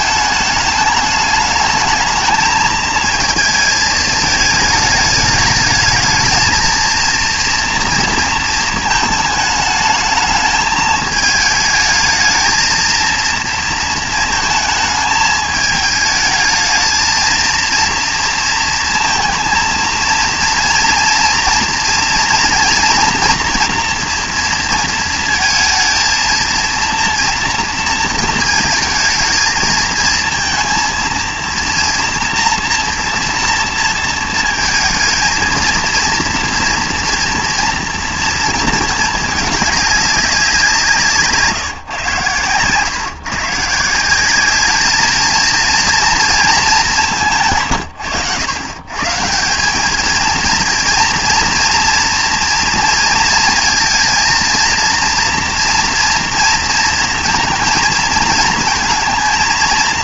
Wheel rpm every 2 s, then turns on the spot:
210, 220, 210, 220, 220, 220, 220, 220, 220, 230, 230, 230, 230, 230, 230, 230, 240, 230, 230, 220, 190, 130, 210, 220, 130, 230, 230, 230, 230, 220.
none